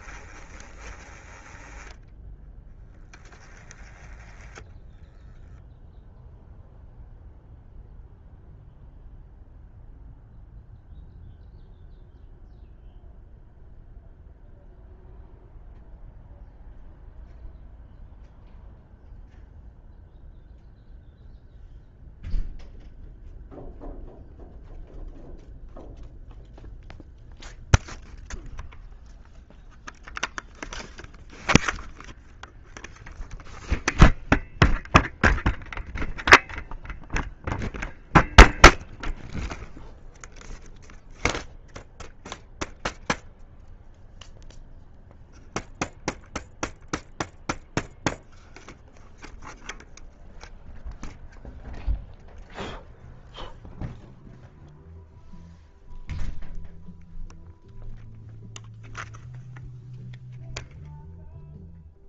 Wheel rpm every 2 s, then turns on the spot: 20, 10, 10, 0, 0, 0, 0, 0, 0, 0, 0, 0, 0, 0, 0, 0, 0, 0, 0, 0, 0, 0, 0, 0, 0, 0, 0, 0, 0, 0, 0.
4-6